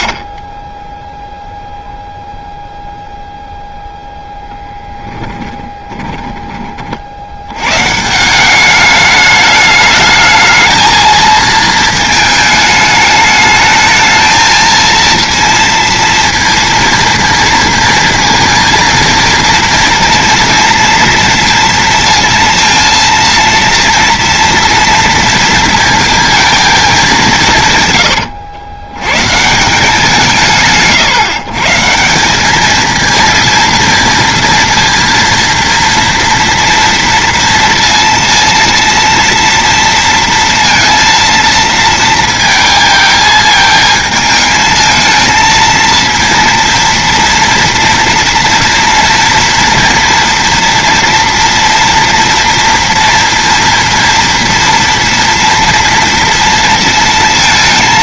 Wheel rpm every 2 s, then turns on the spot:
70, 0, 10, 40, 200, 220, 210, 230, 230, 230, 230, 230, 230, 210, 110, 150, 220, 230, 230, 230, 230, 220, 220, 230, 240, 230, 230, 230, 230.
4-6